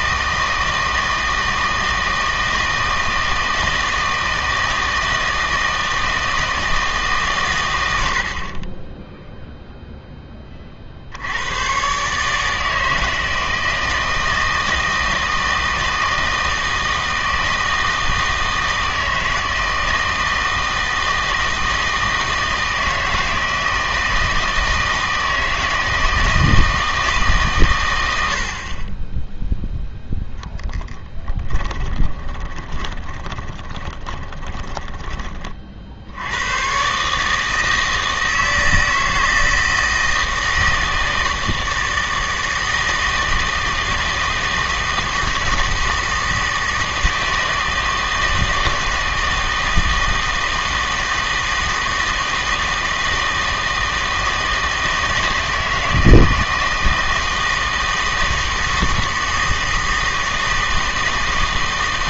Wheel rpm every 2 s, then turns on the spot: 160, 160, 160, 160, 20, 40, 160, 160, 160, 160, 160, 160, 160, 160, 30, 10, 20, 20, 120, 160, 160, 160, 160, 160, 160, 160, 160, 160, 160, 160, 160.
30-36